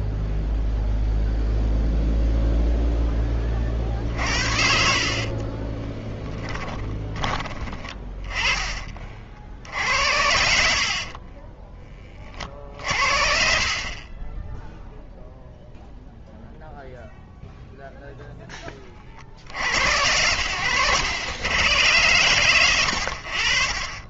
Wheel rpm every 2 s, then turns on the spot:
0, 0, 60, 30, 30, 60, 40, 0, 0, 0, 100, 60.
6-8 20-22